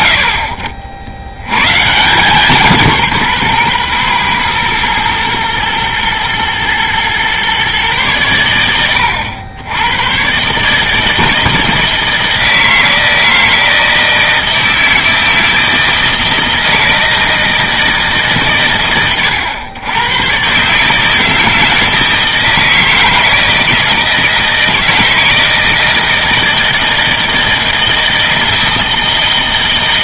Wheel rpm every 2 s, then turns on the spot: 80, 170, 120, 120, 100, 150, 160, 160, 160, 120, 140, 160, 160, 160, 160.
none